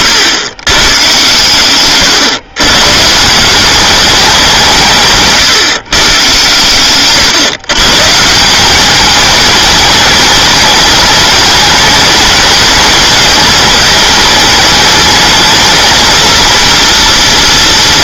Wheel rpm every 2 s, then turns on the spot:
110, 130, 170, 120, 180, 200, 210, 210, 230.
6-8